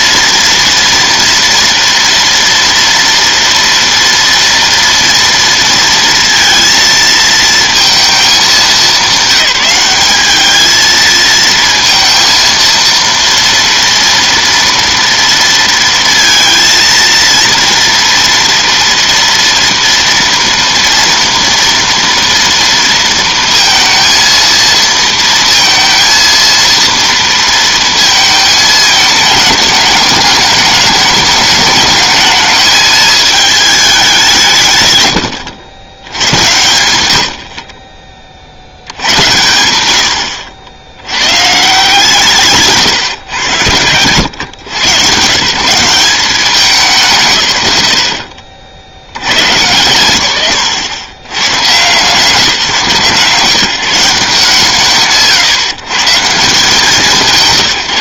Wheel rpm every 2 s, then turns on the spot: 240, 230, 230, 230, 200, 220, 230, 230, 230, 230, 230, 230, 230, 230, 220, 210, 220, 120, 100, 80, 70, 140, 110, 170, 100, 100, 150, 140, 160.
none